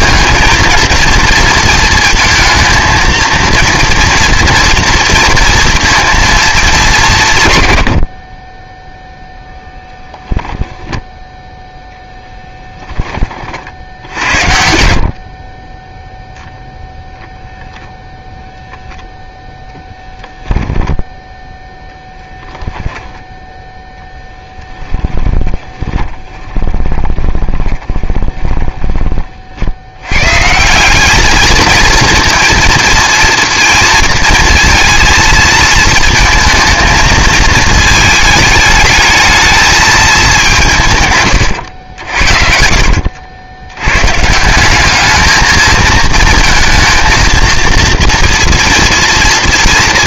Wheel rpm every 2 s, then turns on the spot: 230, 230, 230, 210, 20, 10, 10, 70, 0, 0, 0, 10, 10, 20, 20, 170, 230, 230, 220, 220, 170, 70, 180, 230, 230.
24-28 42-44